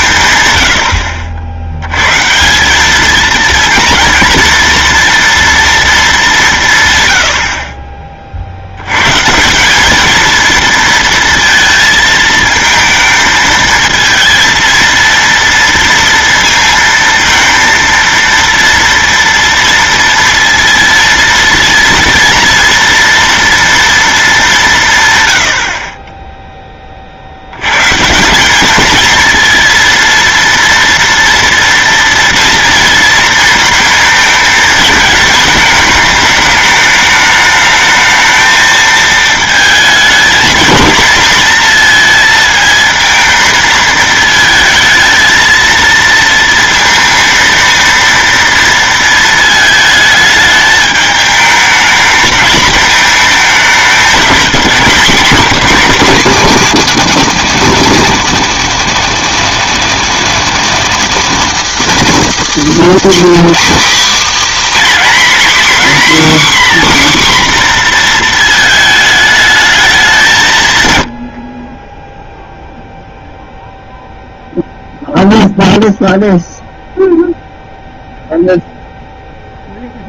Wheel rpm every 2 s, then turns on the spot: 90, 190, 230, 140, 70, 230, 230, 230, 230, 230, 230, 230, 160, 20, 210, 230, 230, 220, 210, 220, 230, 220, 220, 230, 230, 220, 220, 210, 230, 230, 220, 200, 280, 280, 220, 130, 0, 0, 0, 0.
none